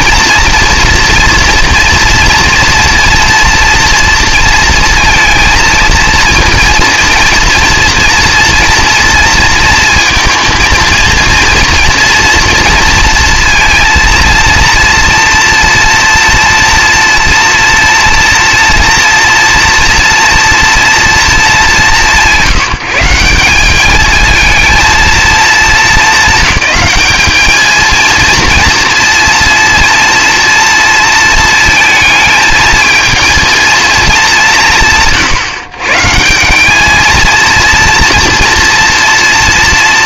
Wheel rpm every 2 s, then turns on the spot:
230, 230, 230, 230, 240, 230, 240, 230, 230, 240, 230, 180, 220, 200, 230, 230, 220, 180, 180, 240.
none